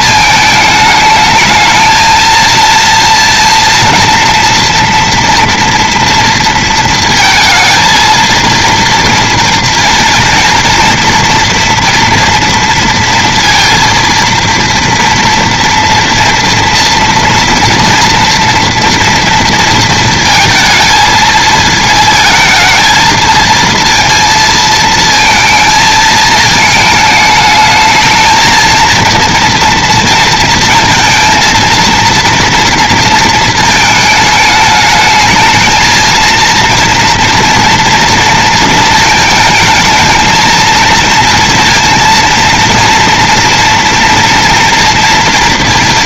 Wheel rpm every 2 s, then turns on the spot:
220, 230, 230, 230, 230, 240, 230, 230, 230, 230, 220, 220, 230, 220, 230, 230, 230, 210, 230, 220, 230, 230, 230.
none